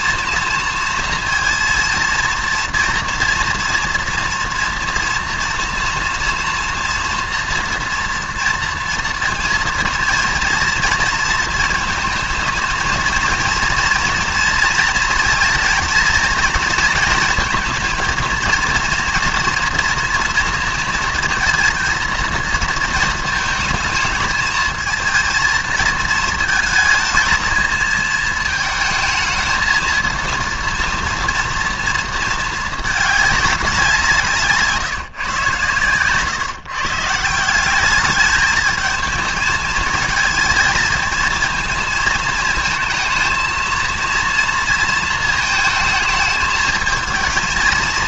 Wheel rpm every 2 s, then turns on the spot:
230, 230, 230, 240, 230, 230, 220, 230, 220, 230, 230, 230, 220, 220, 220, 230, 220, 160, 140, 220, 220, 220, 230, 220.
none